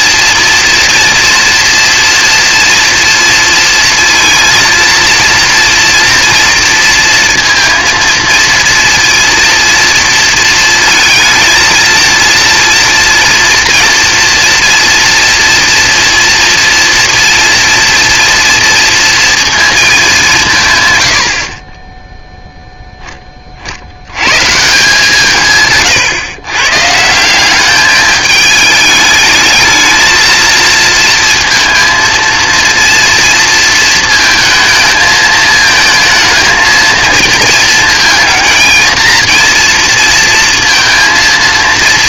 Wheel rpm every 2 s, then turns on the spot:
230, 240, 230, 230, 230, 230, 230, 230, 230, 230, 190, 0, 140, 130, 210, 220, 230, 220, 230, 220, 230.
none